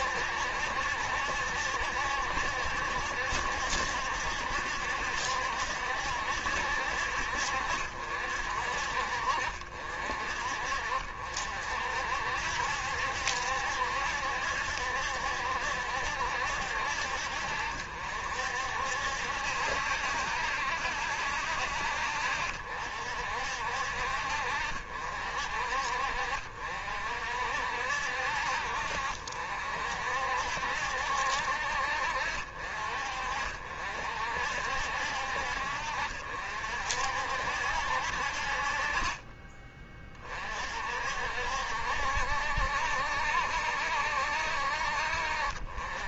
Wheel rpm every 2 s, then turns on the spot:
70, 70, 70, 70, 50, 50, 70, 70, 70, 60, 60, 60, 60, 60, 60, 60, 50, 60, 60, 40, 50, 70, 60.
none